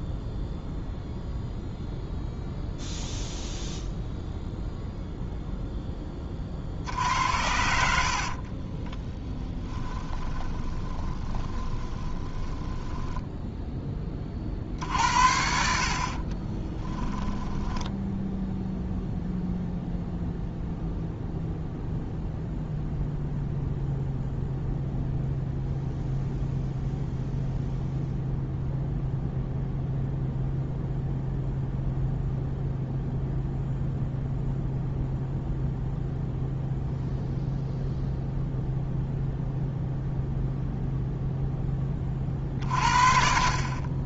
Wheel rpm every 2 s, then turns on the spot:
0, 0, 0, 50, 30, 20, 20, 50, 20, 0, 0, 0, 0, 0, 0, 0, 0, 0, 0, 0, 0, 40.
8-14 16-18